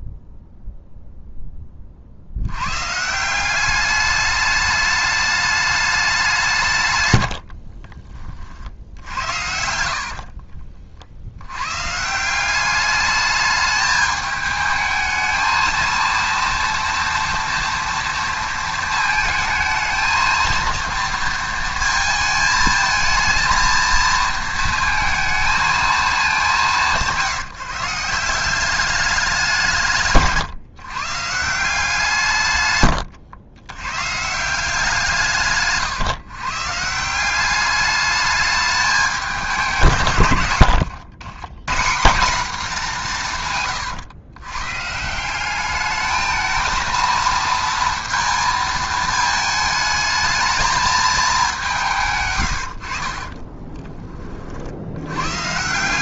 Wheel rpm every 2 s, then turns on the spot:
0, 100, 210, 160, 50, 50, 200, 220, 230, 230, 230, 220, 230, 190, 190, 140, 120, 170, 140, 210, 90, 200, 130, 220, 220, 220, 90, 60.
40-42 52-54